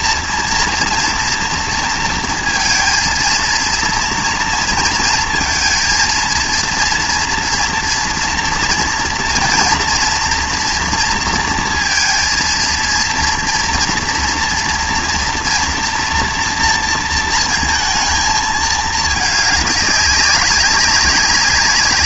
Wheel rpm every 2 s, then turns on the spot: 230, 230, 230, 230, 230, 230, 230, 230, 230, 210, 200.
none